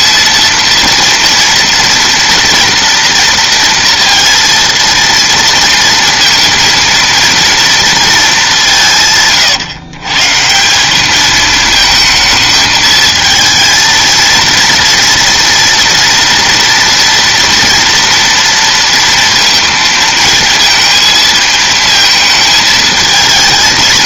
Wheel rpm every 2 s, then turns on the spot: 230, 230, 230, 230, 190, 160, 220, 230, 240, 230, 220, 220.
none